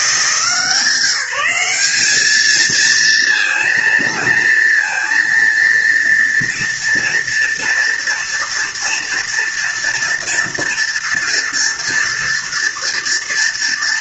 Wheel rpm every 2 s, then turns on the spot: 160, 220, 230, 230, 230, 230, 230.
none